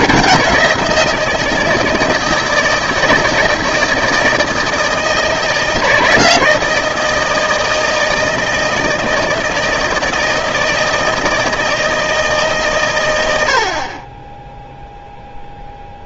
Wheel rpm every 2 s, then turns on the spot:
170, 160, 160, 160, 160, 160, 140, 10.
none